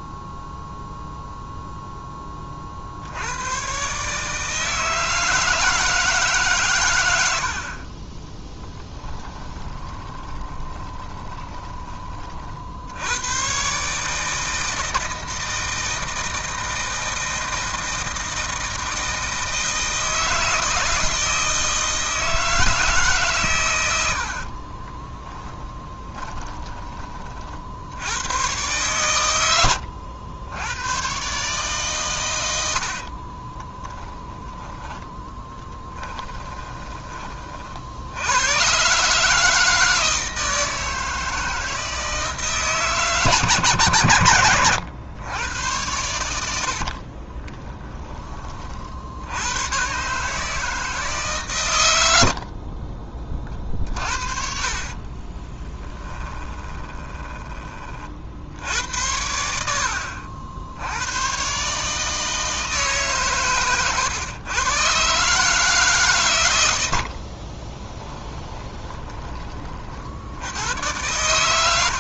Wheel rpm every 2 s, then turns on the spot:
0, 60, 160, 120, 10, 20, 80, 160, 160, 160, 160, 150, 20, 30, 110, 100, 70, 10, 20, 130, 160, 150, 120, 40, 50, 160, 40, 30, 20, 90, 90, 150, 130, 80, 20, 110.
8-12 24-26 32-34 46-48 52-58 68-70